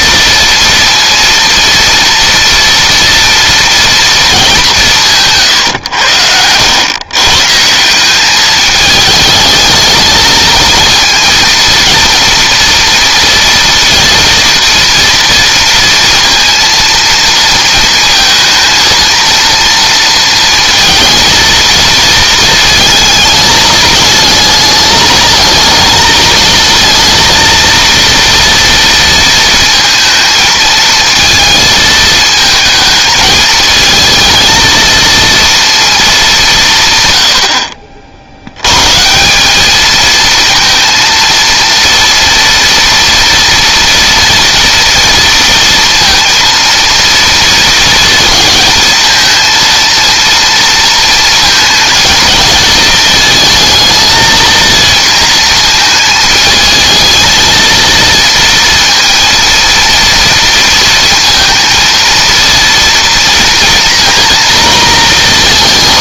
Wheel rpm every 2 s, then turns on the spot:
230, 230, 180, 110, 210, 230, 230, 230, 230, 230, 230, 220, 220, 230, 230, 220, 220, 230, 150, 120, 230, 230, 230, 230, 220, 230, 220, 230, 220, 230, 230, 230, 230.
none